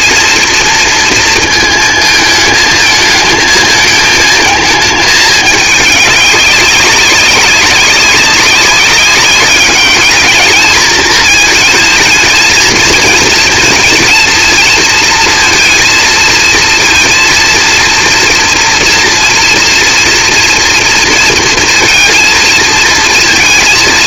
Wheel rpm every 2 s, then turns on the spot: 230, 220, 220, 200, 200, 220, 220, 230, 230, 230, 230, 230.
none